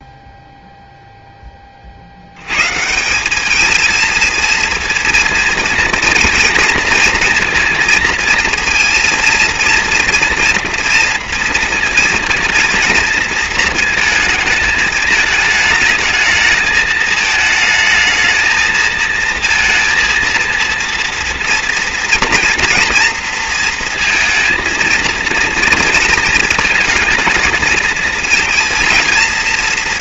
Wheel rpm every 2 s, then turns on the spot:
0, 130, 230, 230, 230, 230, 230, 210, 220, 220, 230, 230, 230, 230, 230.
none